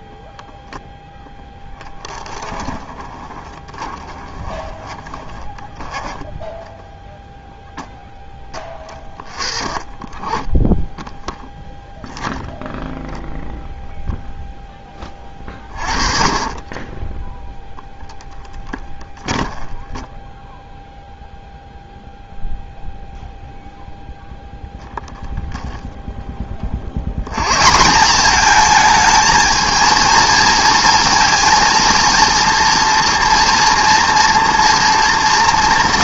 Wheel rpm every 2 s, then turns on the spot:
10, 20, 10, 0, 10, 0, 0, 10, 20, 10, 0, 0, 10, 90, 220, 230, 230, 230.
0-6 18-20